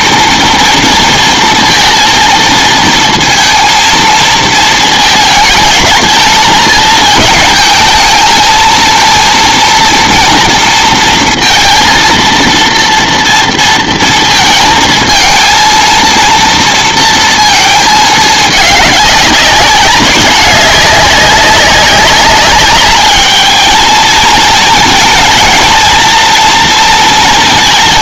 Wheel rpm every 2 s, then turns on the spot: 230, 230, 230, 220, 220, 230, 230, 220, 230, 210, 200, 210, 220, 230.
none